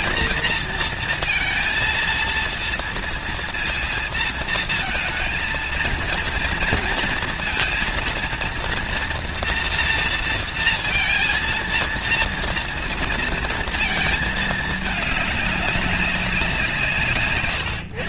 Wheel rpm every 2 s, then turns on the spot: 230, 230, 230, 230, 240, 230, 230, 220, 180.
none